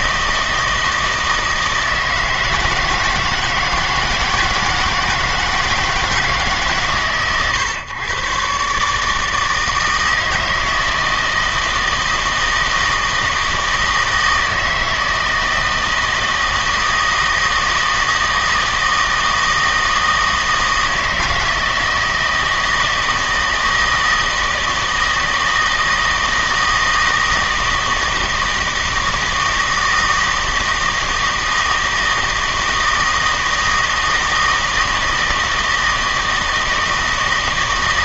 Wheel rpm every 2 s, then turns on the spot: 160, 160, 160, 150, 140, 160, 160, 160, 160, 160, 160, 160, 160, 160, 160, 160, 160, 160, 160.
none